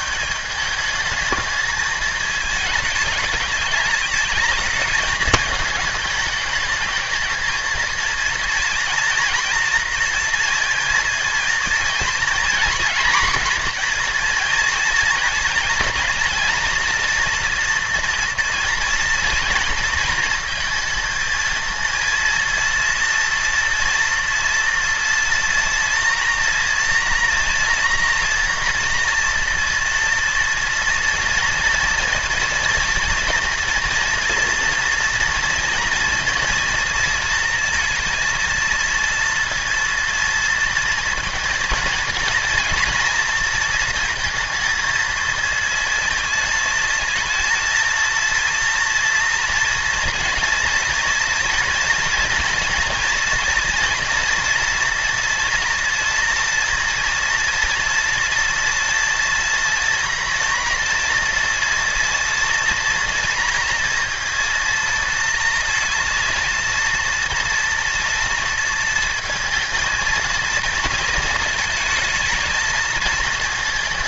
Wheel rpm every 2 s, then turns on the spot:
200, 210, 210, 210, 230, 230, 230, 230, 230, 230, 230, 230, 230, 240, 230, 230, 230, 230, 230, 230, 230, 230, 230, 220, 230, 230, 230, 240, 230, 230, 230, 230, 230, 230, 230, 230, 220.
none